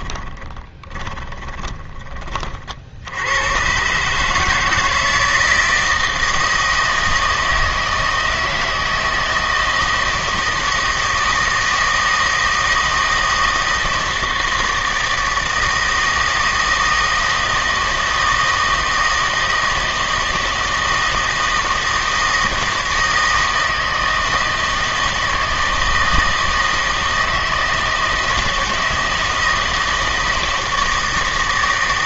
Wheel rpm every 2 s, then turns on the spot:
20, 50, 160, 160, 160, 160, 160, 160, 160, 160, 160, 160, 160, 160, 160, 160.
0-2